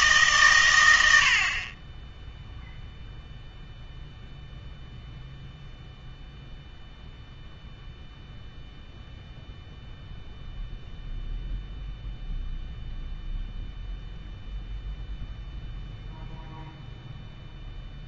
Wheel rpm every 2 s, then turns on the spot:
110, 0, 0, 0, 0, 0, 0, 0, 0.
none